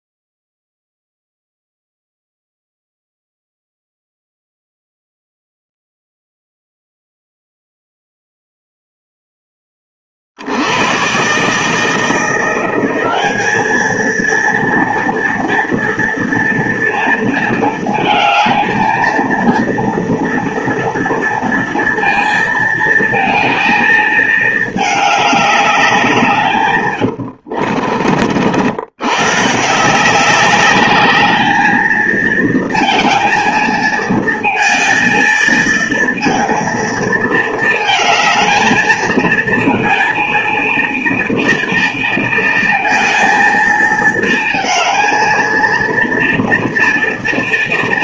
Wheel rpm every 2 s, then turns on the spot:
0, 0, 0, 0, 0, 80, 180, 230, 230, 220, 230, 230, 220, 140, 80, 200, 230, 220, 230, 220, 230, 230, 230, 230.
26-28